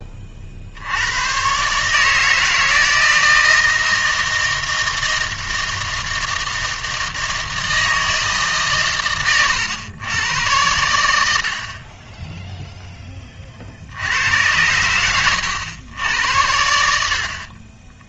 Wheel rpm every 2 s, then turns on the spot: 60, 160, 160, 160, 140, 100, 10, 90, 80.
none